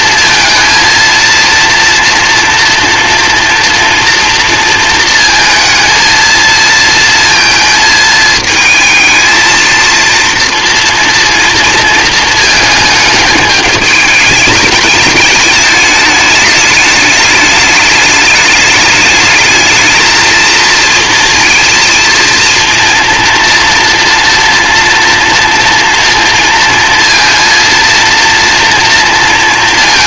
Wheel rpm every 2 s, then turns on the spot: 230, 230, 230, 230, 220, 230, 220, 210, 210, 210, 230, 230, 240, 230, 230.
none